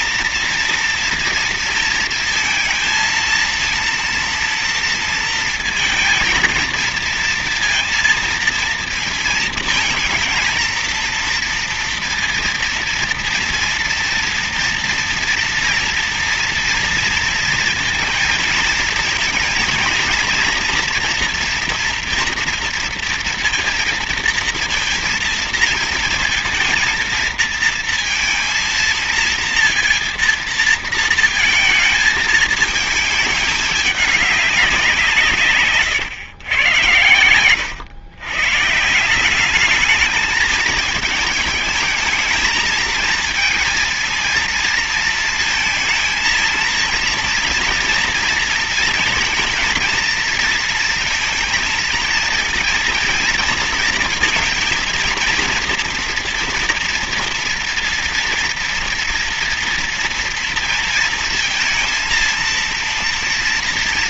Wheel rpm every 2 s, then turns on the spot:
230, 230, 230, 230, 230, 230, 230, 230, 230, 230, 230, 230, 230, 230, 220, 230, 220, 180, 110, 130, 210, 220, 230, 230, 230, 230, 230, 230, 230, 230, 230, 230.
none